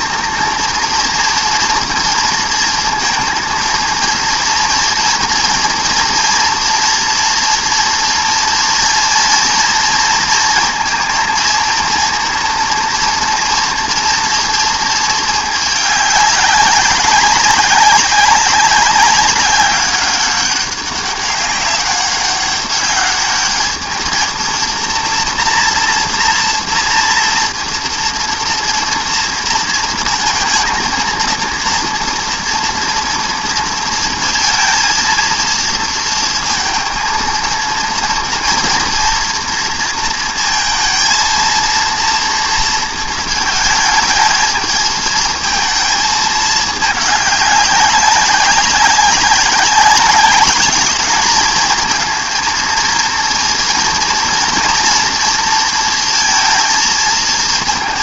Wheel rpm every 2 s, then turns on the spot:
230, 230, 230, 230, 230, 230, 230, 220, 200, 200, 200, 200, 230, 230, 230, 230, 230, 230, 230, 230, 230, 230, 220, 210, 190, 200, 230, 230, 220.
none